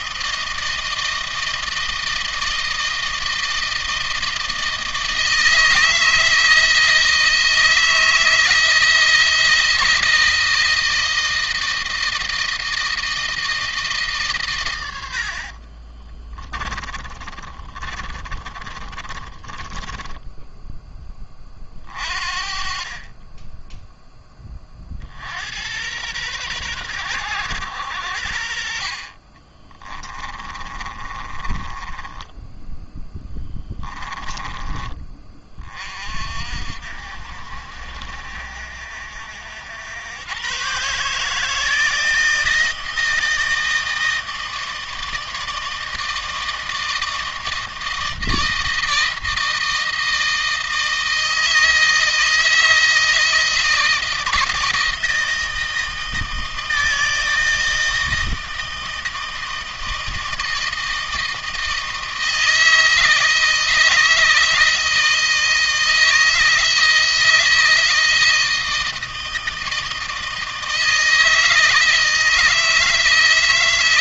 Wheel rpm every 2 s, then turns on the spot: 160, 160, 160, 160, 160, 160, 160, 90, 30, 30, 20, 30, 50, 110, 40, 30, 10, 30, 50, 60, 140, 160, 160, 160, 160, 160, 160, 160, 160, 160, 160, 160, 160, 160, 160, 160, 160.
16-20 28-34